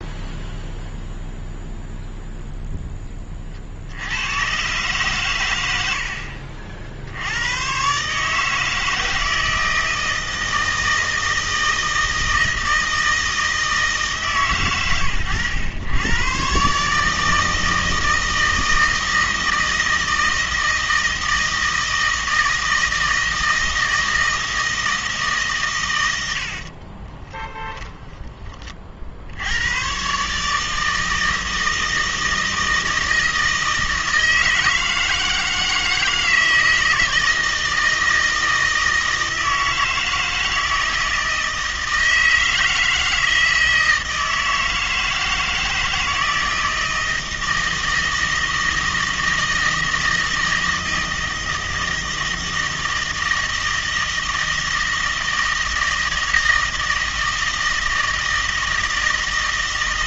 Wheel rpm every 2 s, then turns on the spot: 0, 10, 130, 70, 160, 160, 160, 110, 140, 160, 160, 160, 160, 40, 40, 160, 160, 160, 160, 160, 160, 160, 160, 160, 160, 160, 160, 160, 160, 160.
26-28